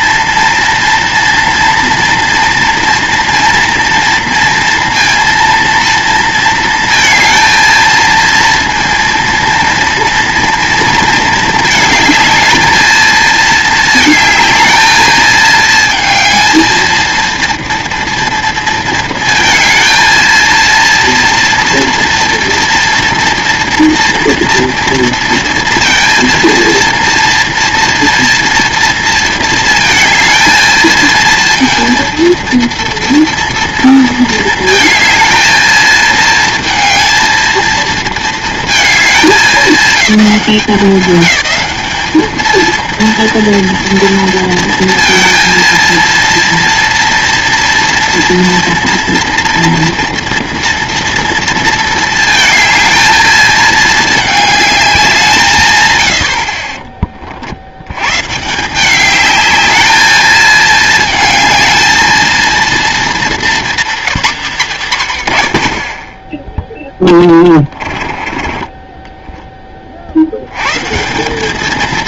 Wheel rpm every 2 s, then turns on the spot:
230, 230, 230, 220, 230, 230, 220, 220, 220, 230, 230, 230, 230, 230, 230, 230, 230, 220, 220, 220, 190, 230, 230, 230, 230, 230, 220, 200, 40, 170, 220, 220, 180, 0, 10, 120.
68-70